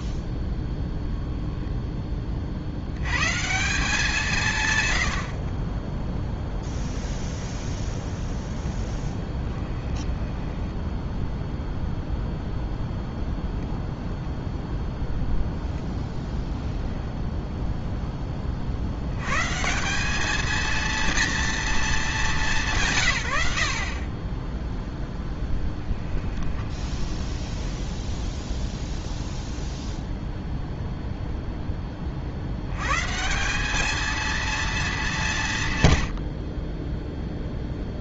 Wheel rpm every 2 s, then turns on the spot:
0, 60, 140, 0, 10, 10, 0, 0, 0, 50, 220, 170, 0, 10, 0, 0, 110, 220, 30.
8-12 26-28